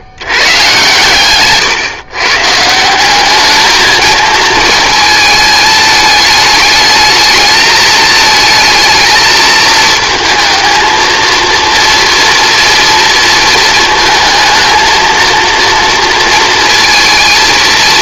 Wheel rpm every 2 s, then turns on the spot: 130, 170, 230, 220, 220, 220, 230, 230, 230.
none